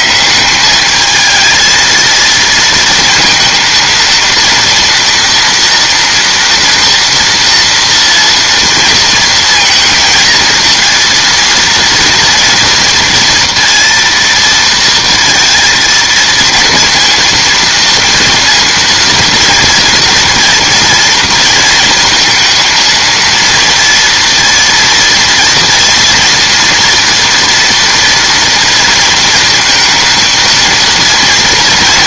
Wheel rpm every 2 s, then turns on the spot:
200, 220, 230, 230, 230, 230, 230, 230, 230, 230, 230, 230, 230, 230, 230, 230.
none